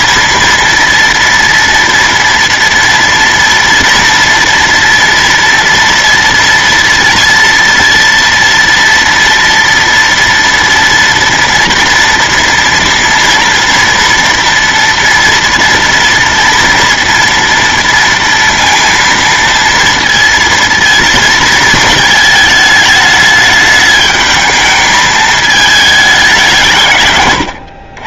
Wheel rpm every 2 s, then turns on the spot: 230, 230, 230, 230, 230, 230, 230, 230, 230, 230, 230, 210, 220, 160.
none